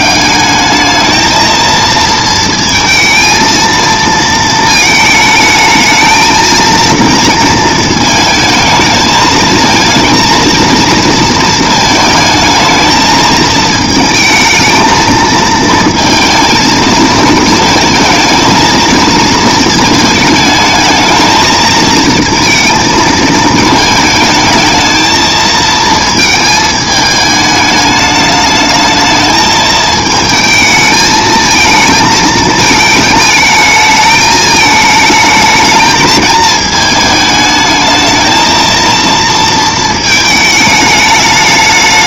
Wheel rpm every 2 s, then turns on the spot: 210, 220, 220, 220, 220, 230, 220, 220, 230, 230, 220, 220, 220, 220, 220, 220, 220, 220, 220, 230, 220.
none